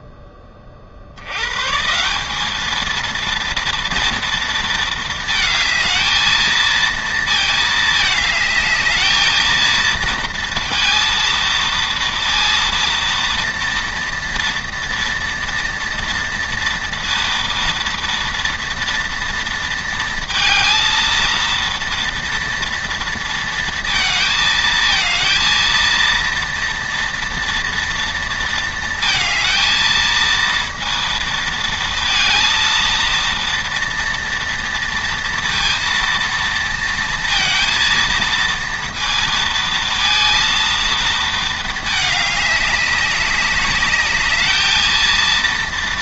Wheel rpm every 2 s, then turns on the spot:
100, 230, 220, 230, 220, 230, 230, 240, 230, 230, 230, 230, 230, 230, 220, 230, 230, 230, 230, 230, 220, 200, 230.
none